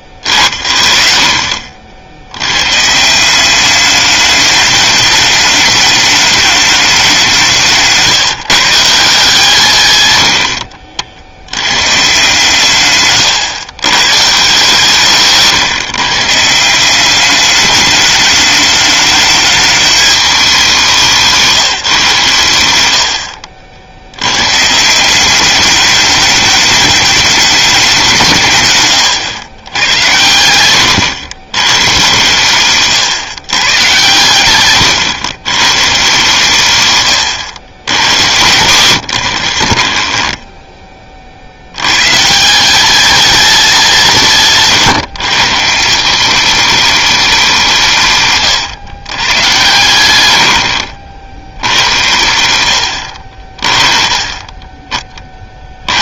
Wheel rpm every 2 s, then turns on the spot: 40, 130, 210, 200, 180, 50, 150, 150, 180, 210, 170, 110, 150, 210, 140, 120, 130, 120, 120, 90, 10, 200, 160, 210, 130, 60, 70, 20.
10-12